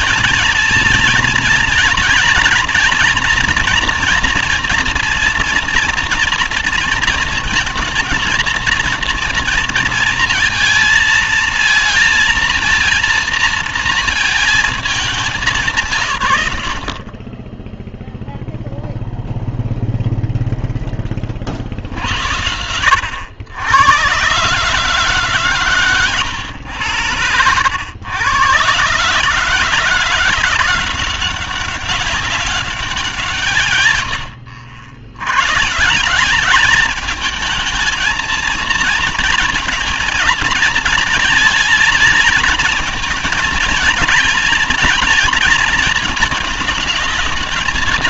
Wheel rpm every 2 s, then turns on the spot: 230, 220, 230, 230, 220, 220, 230, 220, 90, 0, 0, 80, 140, 100, 120, 180, 200, 70, 210, 230, 230, 220, 230, 220.
none